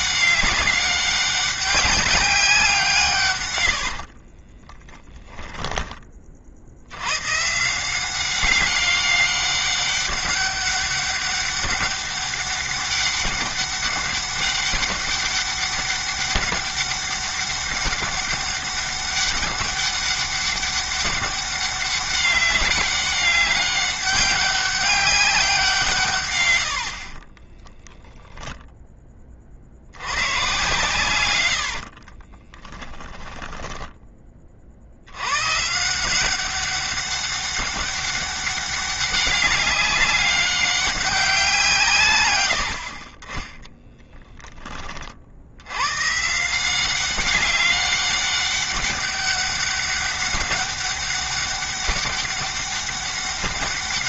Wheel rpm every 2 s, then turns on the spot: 200, 160, 10, 90, 200, 200, 200, 200, 200, 200, 200, 200, 200, 60, 10, 130, 20, 40, 190, 200, 200, 70, 30, 170, 200, 200, 200.
4-6 26-28 32-34 42-44